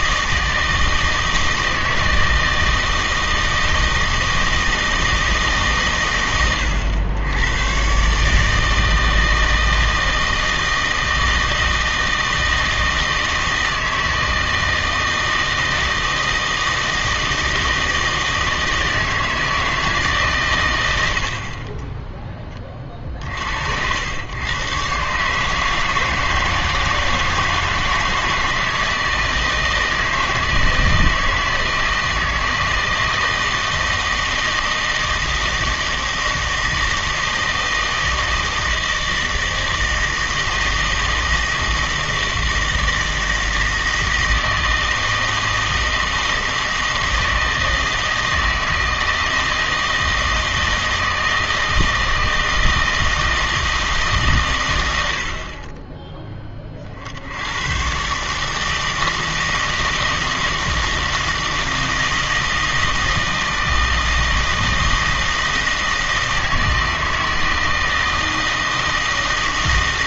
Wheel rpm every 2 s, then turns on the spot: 160, 160, 160, 110, 160, 160, 160, 160, 160, 160, 130, 30, 120, 160, 160, 170, 160, 160, 160, 160, 160, 160, 160, 160, 160, 160, 160, 120, 30, 150, 160, 160, 160, 160, 160.
none